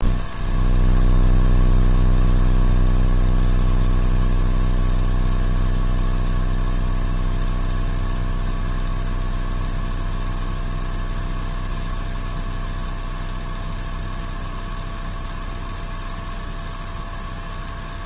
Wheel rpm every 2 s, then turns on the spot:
0, 0, 0, 0, 0, 0, 0, 0, 0.
none